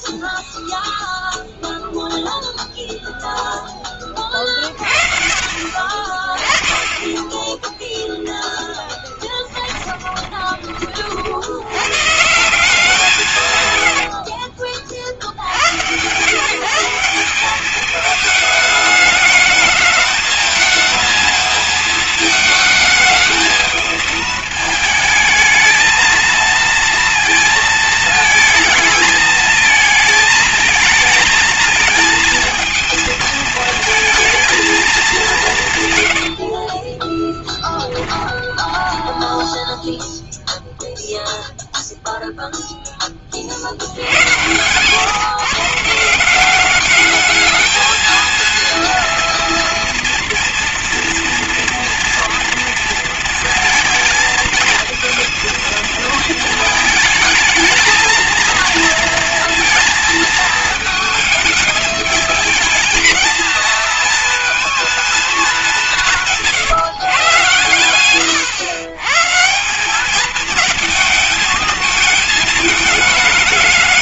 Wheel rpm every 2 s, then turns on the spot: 0, 0, 40, 30, 10, 20, 160, 60, 160, 210, 220, 220, 220, 230, 220, 220, 230, 230, 50, 30, 0, 0, 120, 200, 230, 230, 230, 230, 220, 230, 220, 220, 230, 160, 110, 220, 210.
36-40